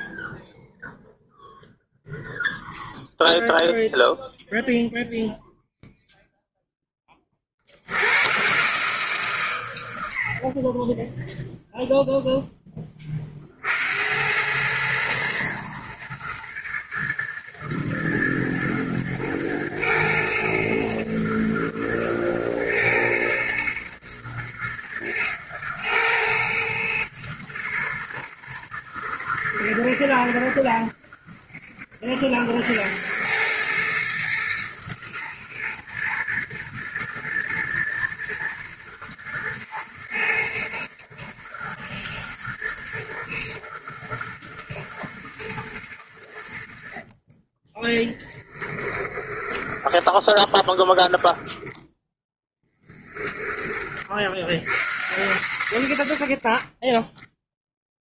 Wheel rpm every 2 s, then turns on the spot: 0, 50, 120, 0, 40, 110, 120, 110, 110, 110, 110, 110, 110, 90, 90, 110, 110, 110, 110, 110, 120, 110, 40, 20, 10, 10, 70, 10, 0.
44-52